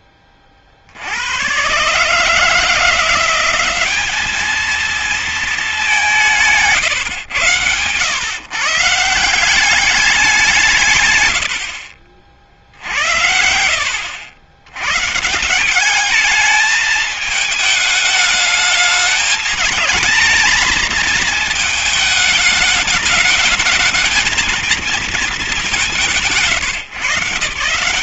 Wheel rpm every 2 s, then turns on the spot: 30, 150, 220, 180, 130, 180, 50, 80, 210, 210, 220, 210, 220, 160.
none